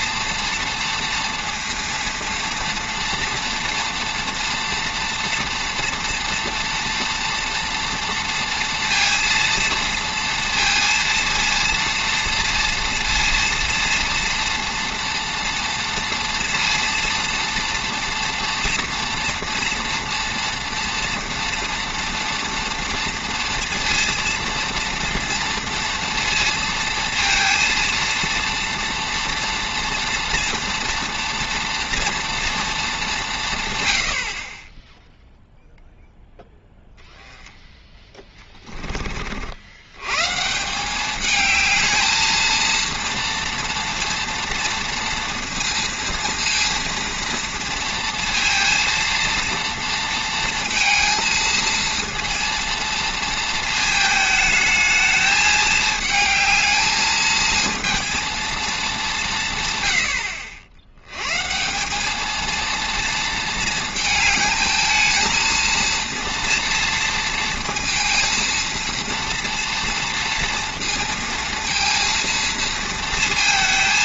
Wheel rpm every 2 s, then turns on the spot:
230, 230, 230, 230, 230, 230, 230, 230, 230, 230, 230, 230, 230, 230, 230, 240, 230, 30, 0, 20, 170, 230, 230, 230, 230, 230, 230, 220, 220, 220, 80, 230, 220, 230, 230, 230, 230.
none